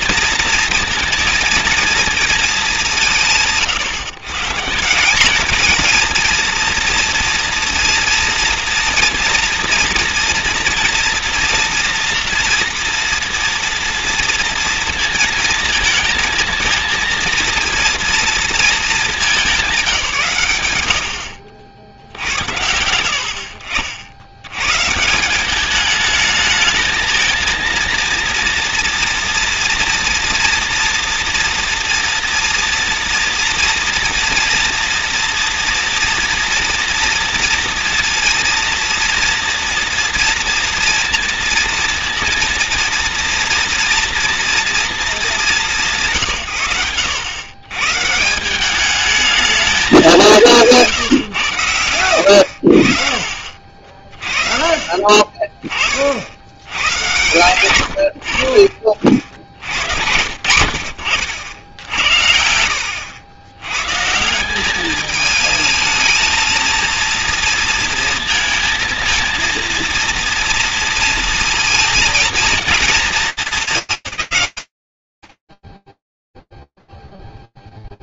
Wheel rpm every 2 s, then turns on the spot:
230, 160, 220, 230, 230, 230, 230, 230, 230, 200, 50, 50, 180, 220, 230, 240, 230, 240, 230, 230, 230, 230, 210, 110, 210, 140, 40, 30, 100, 40, 60, 70, 190, 220, 230, 230, 230, 160, 0.
none